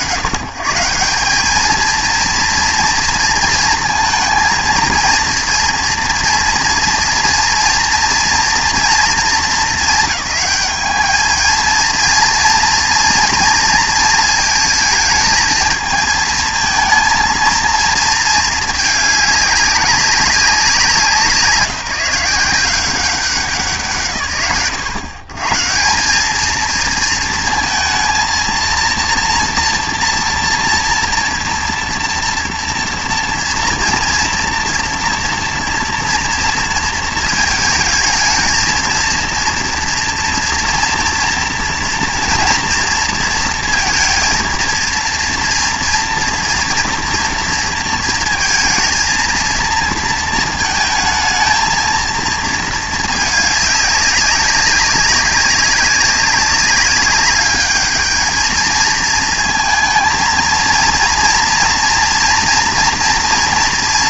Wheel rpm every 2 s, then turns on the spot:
120, 230, 230, 230, 230, 210, 230, 220, 220, 220, 180, 180, 100, 220, 230, 230, 230, 240, 230, 230, 230, 230, 230, 230, 230, 220, 220, 190, 200, 220, 230, 230.
none